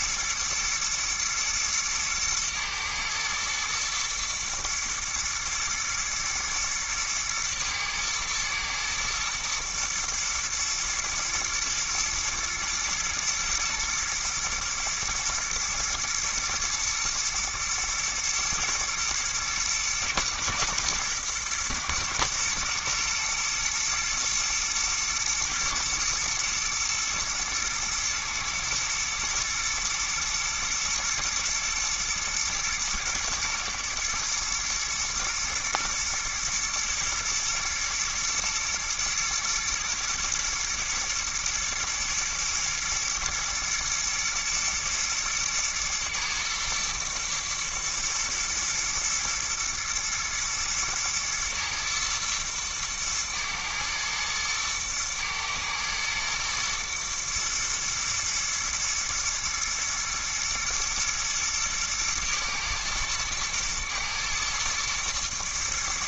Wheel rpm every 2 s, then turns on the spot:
110, 110, 110, 110, 110, 110, 120, 110, 120, 120, 120, 120, 120, 120, 110, 120, 120, 110, 120, 120, 120, 120, 120, 110, 120, 110, 110, 110, 120, 110, 110, 110, 110.
none